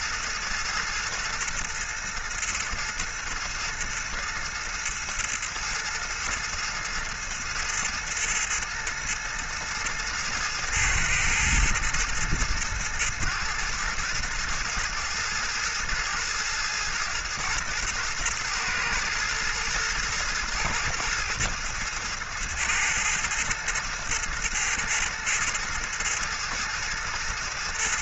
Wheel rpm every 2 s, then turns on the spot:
110, 110, 110, 110, 110, 110, 110, 110, 110, 110, 110, 110, 110, 110.
none